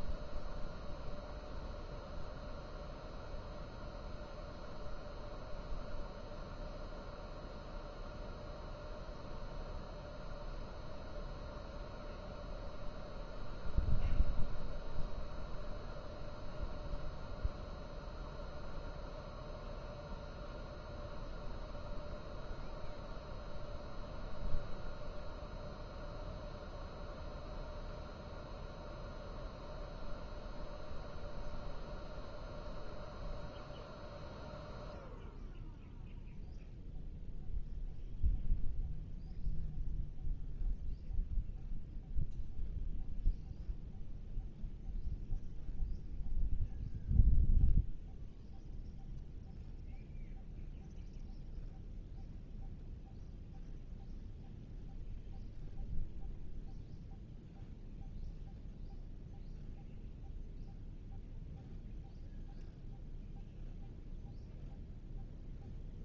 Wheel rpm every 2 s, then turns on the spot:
0, 0, 0, 0, 0, 0, 0, 0, 0, 0, 0, 0, 0, 0, 0, 0, 0, 0, 0, 0, 0, 0, 0, 0, 0, 0, 0, 0, 0, 0, 0, 0, 0.
none